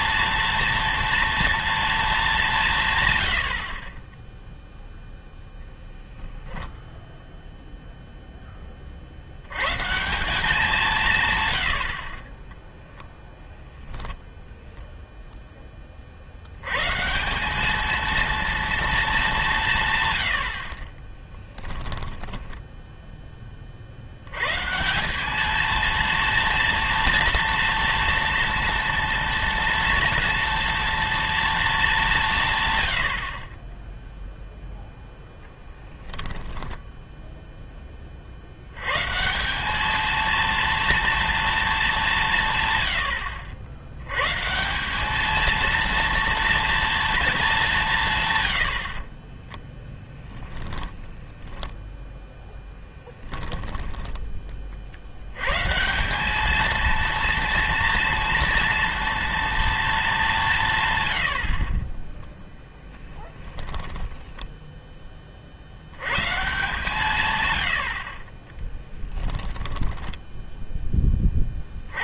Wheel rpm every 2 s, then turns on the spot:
230, 170, 0, 10, 20, 190, 0, 0, 90, 230, 50, 10, 140, 230, 230, 230, 120, 0, 10, 90, 230, 130, 170, 230, 90, 10, 0, 30, 220, 230, 140, 10, 10, 140, 20, 10.
22-24 36-38 50-52 64-66 68-70